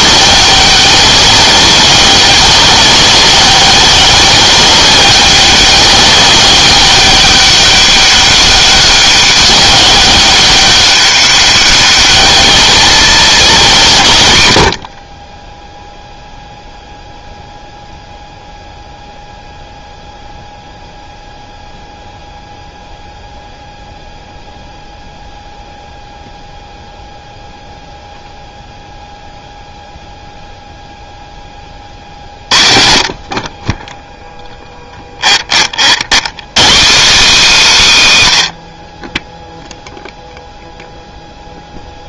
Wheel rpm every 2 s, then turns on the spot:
200, 200, 200, 200, 200, 190, 210, 90, 0, 0, 0, 0, 0, 0, 0, 0, 50, 0, 140, 130, 0.
none